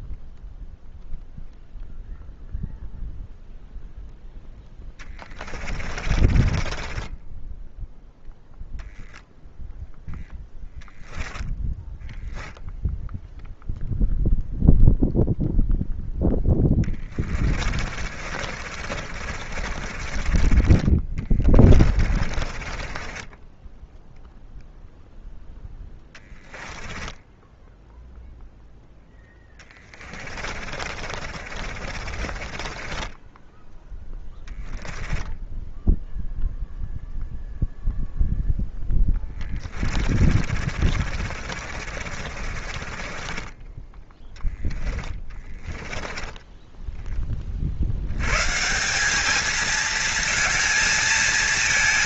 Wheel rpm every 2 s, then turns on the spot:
0, 0, 10, 20, 0, 10, 0, 0, 20, 40, 30, 30, 0, 10, 0, 50, 30, 10, 0, 20, 40, 30, 20, 10, 170, 220.
4-8 10-12 16-20 22-24 26-28 30-36 38-46